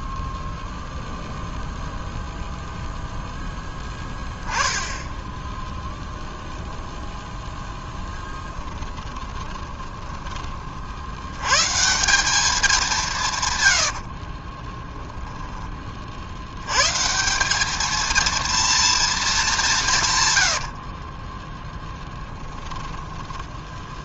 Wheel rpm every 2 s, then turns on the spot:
0, 0, 10, 0, 20, 50, 190, 20, 110, 230, 70, 10.
8-10 14-16 20-22